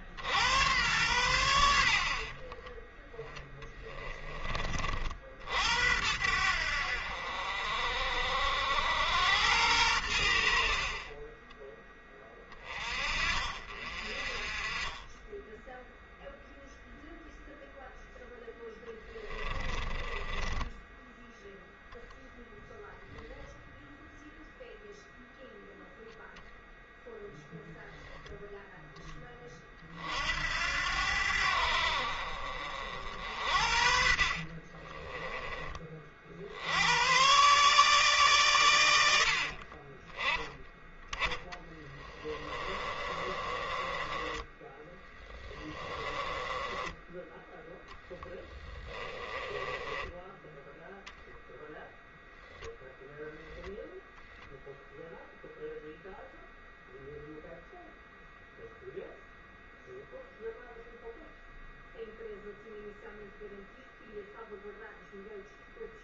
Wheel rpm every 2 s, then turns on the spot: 100, 10, 40, 70, 80, 40, 30, 20, 0, 10, 10, 0, 0, 0, 10, 80, 60, 20, 100, 90, 10, 20, 10, 10, 20, 0, 0, 10, 0, 0, 0, 0, 0.
18-22 34-36 42-46 48-50